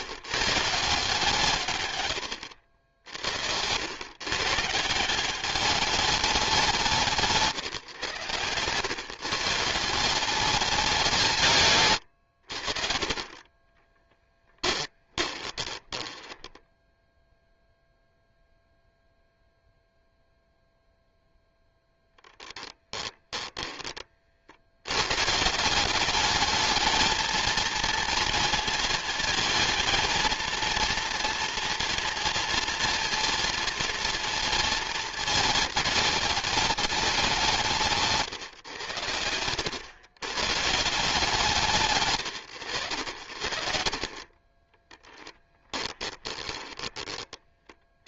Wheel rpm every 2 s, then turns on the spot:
160, 80, 150, 180, 120, 180, 50, 20, 10, 0, 0, 10, 90, 220, 220, 230, 230, 220, 200, 110, 140, 90, 20, 20.
14-18 22-24 46-48